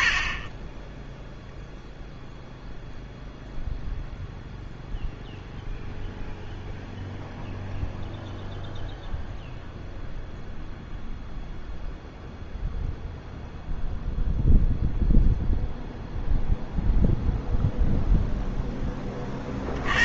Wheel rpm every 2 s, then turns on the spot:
40, 0, 0, 0, 0, 0, 0, 0, 0, 0.
0-2